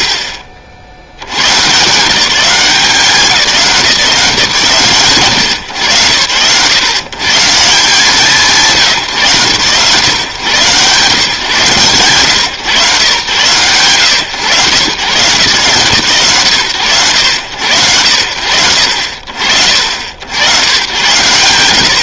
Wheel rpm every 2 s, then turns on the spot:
50, 190, 140, 130, 150, 120, 120, 110, 110, 50, 90.
none